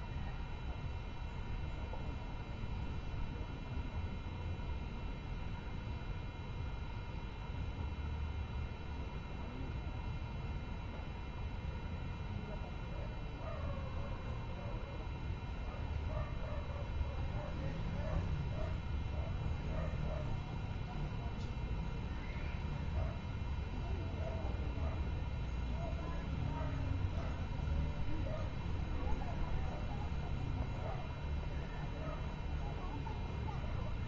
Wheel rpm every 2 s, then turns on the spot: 0, 0, 0, 0, 0, 0, 0, 0, 0, 0, 0, 0, 0, 0, 0, 0, 0.
none